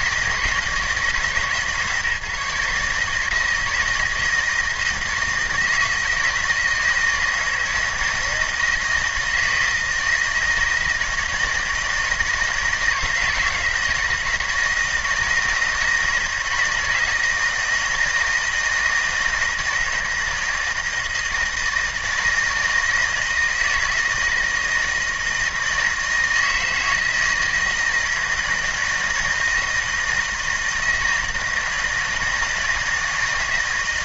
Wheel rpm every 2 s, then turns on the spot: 160, 150, 160, 160, 160, 160, 160, 160, 160, 160, 160, 160, 160, 160, 160, 160, 160.
none